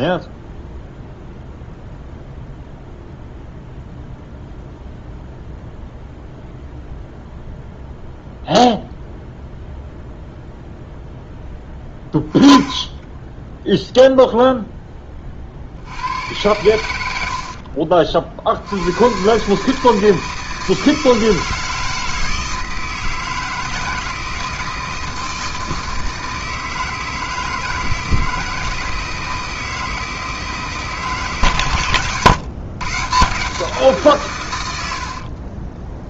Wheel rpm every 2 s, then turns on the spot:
0, 0, 0, 0, 0, 0, 20, 10, 80, 70, 160, 160, 160, 160, 160, 160, 140, 100.
12-14